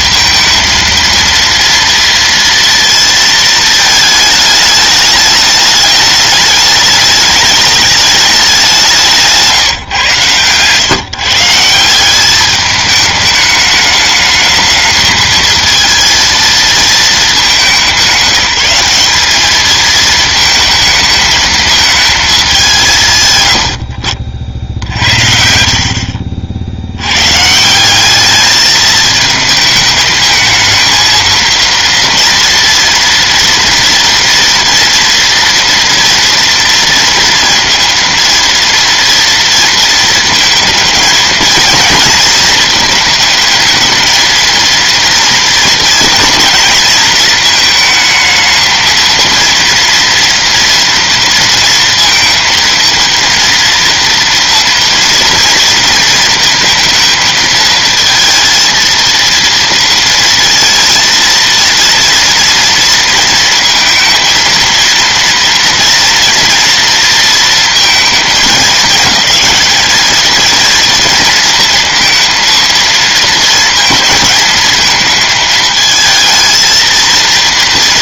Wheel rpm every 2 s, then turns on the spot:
230, 230, 220, 210, 210, 140, 190, 210, 230, 190, 220, 190, 60, 50, 210, 220, 230, 240, 230, 230, 230, 230, 230, 220, 220, 230, 230, 230, 230, 230, 230, 230, 230, 230, 210, 220, 230, 220, 220.
none